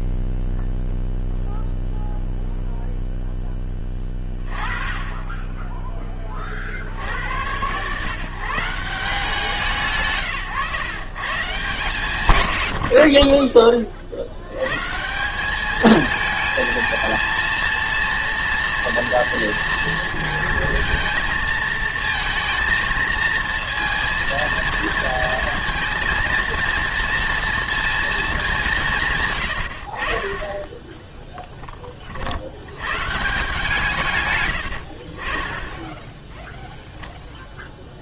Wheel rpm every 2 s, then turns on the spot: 0, 0, 20, 30, 160, 120, 100, 120, 220, 230, 230, 230, 230, 230, 180, 10, 90, 90, 0.
34-36